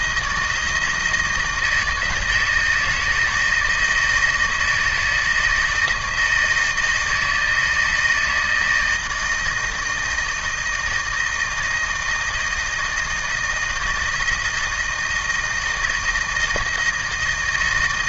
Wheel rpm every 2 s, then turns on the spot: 160, 160, 160, 160, 160, 170, 160, 160, 160.
none